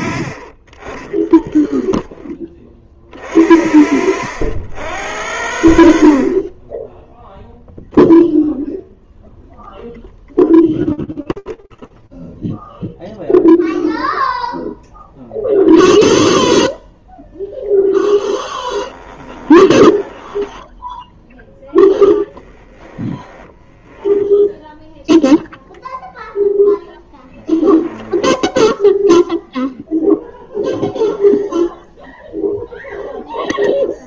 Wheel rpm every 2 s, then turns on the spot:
40, 10, 70, 30, 0, 0, 0, 0, 0, 20, 10, 10, 0, 0, 0, 0, 0.
18-24